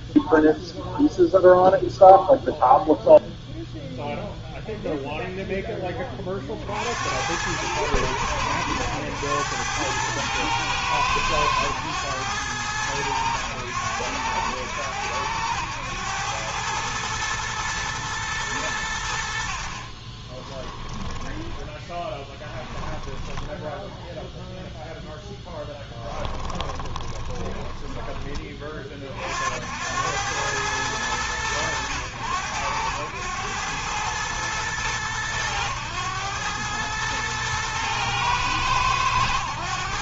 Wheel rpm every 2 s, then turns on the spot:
0, 0, 0, 30, 100, 110, 100, 90, 100, 110, 20, 10, 0, 10, 30, 100, 90, 110, 100, 110.
20-24 26-28